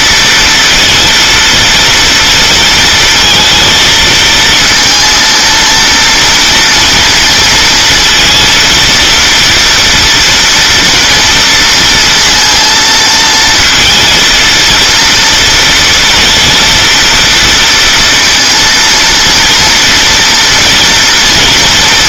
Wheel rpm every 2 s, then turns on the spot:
230, 230, 230, 230, 230, 240, 230, 230, 230, 230, 230.
none